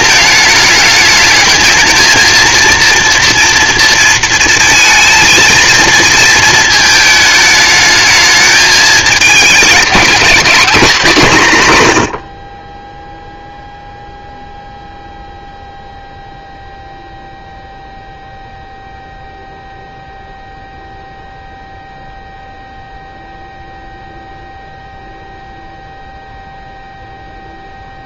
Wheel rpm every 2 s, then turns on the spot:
220, 230, 230, 220, 210, 210, 40, 0, 0, 0, 0, 0, 0, 0.
none